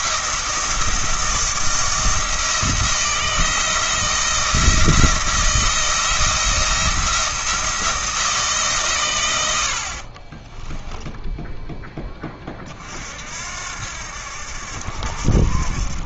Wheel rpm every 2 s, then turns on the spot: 170, 170, 170, 170, 150, 20, 30, 70.
10-12